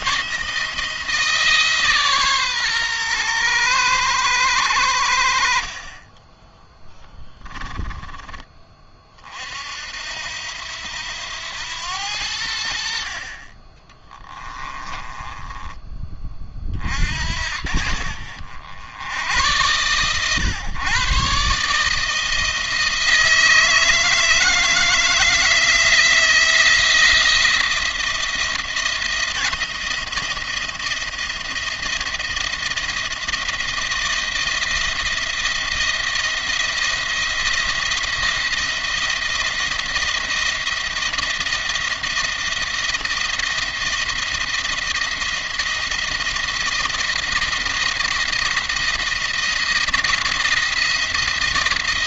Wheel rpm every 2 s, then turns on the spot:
160, 130, 90, 10, 30, 80, 70, 20, 30, 60, 130, 160, 160, 170, 170, 170, 170, 170, 170, 170, 160, 160, 170, 170, 170, 170.
14-16